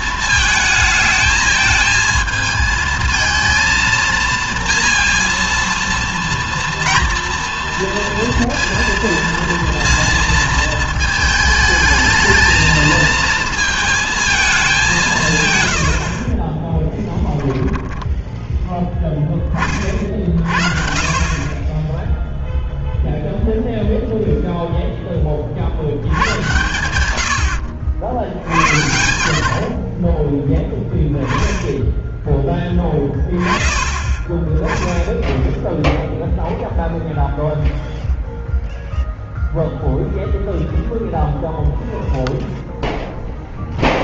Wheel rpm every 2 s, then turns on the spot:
220, 220, 230, 230, 230, 220, 220, 190, 20, 10, 40, 0, 0, 110, 70, 10, 20, 10, 0, 0, 0, 0.
16-18